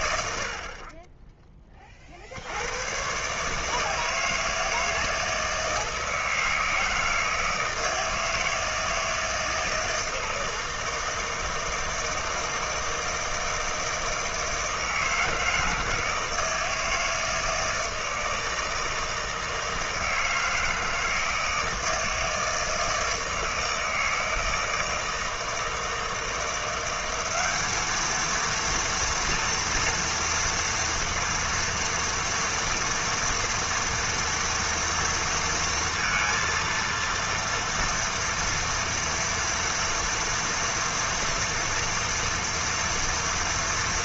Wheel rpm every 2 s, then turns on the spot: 10, 120, 160, 160, 160, 160, 160, 160, 160, 160, 160, 160, 160, 190, 230, 230, 230, 230, 230, 230, 230, 230.
none